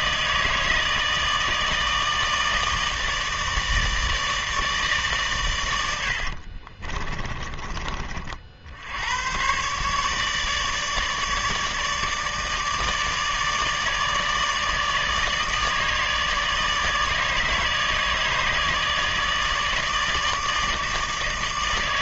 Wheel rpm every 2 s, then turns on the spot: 160, 160, 150, 50, 70, 150, 160, 160, 150, 160, 160.
6-8